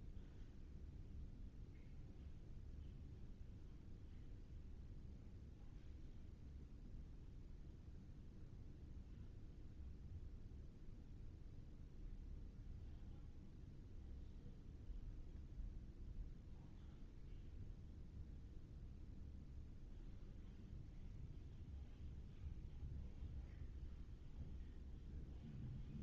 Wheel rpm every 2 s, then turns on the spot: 0, 0, 0, 0, 0, 0, 0, 0, 0, 0, 0, 0, 0.
none